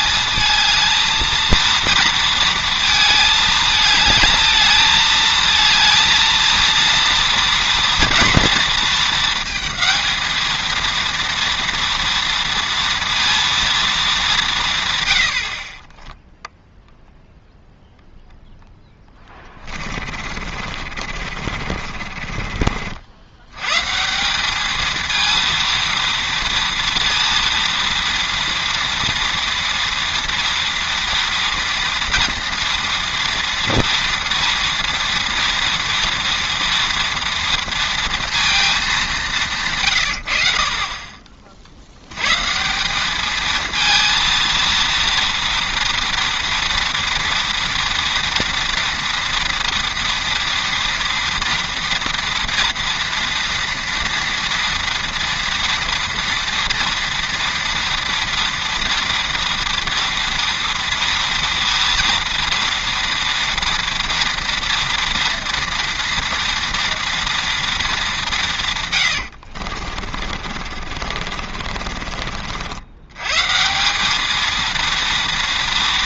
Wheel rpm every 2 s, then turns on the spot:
220, 230, 220, 230, 230, 230, 230, 150, 0, 0, 40, 50, 210, 230, 230, 230, 240, 240, 230, 220, 50, 170, 230, 230, 240, 230, 230, 240, 230, 230, 230, 230, 230, 230, 150, 40, 60, 230.
20-22 70-72